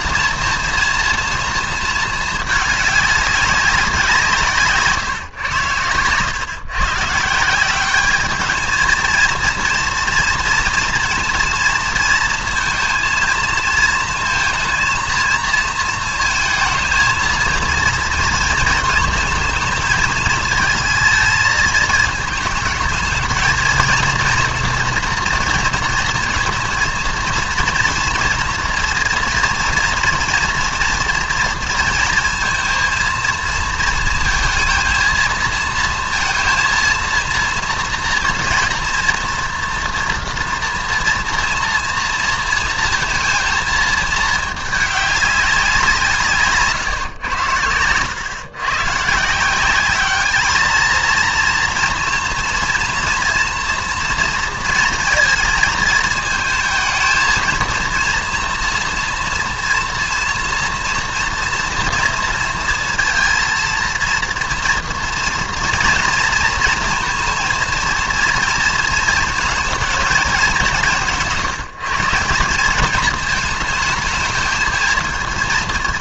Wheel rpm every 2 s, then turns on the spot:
230, 210, 150, 130, 220, 230, 230, 230, 220, 230, 220, 220, 230, 230, 230, 230, 230, 230, 230, 230, 230, 230, 210, 150, 130, 230, 240, 230, 220, 230, 240, 230, 230, 220, 220, 190, 200, 220.
none